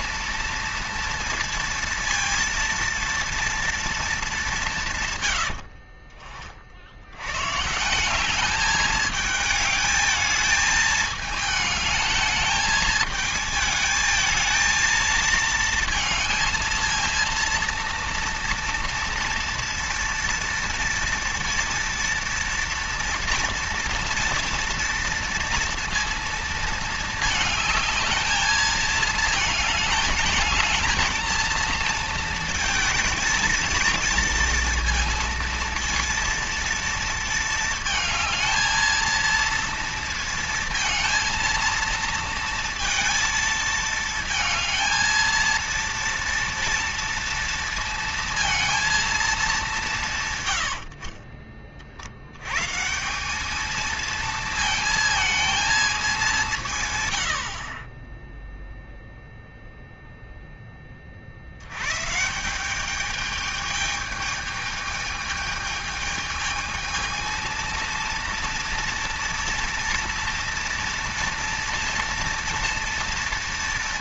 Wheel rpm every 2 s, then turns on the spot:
230, 230, 160, 60, 210, 220, 220, 220, 230, 230, 230, 230, 230, 220, 220, 220, 220, 230, 230, 220, 230, 230, 220, 230, 230, 90, 150, 220, 140, 0, 20, 190, 220, 220, 230, 230, 220.
none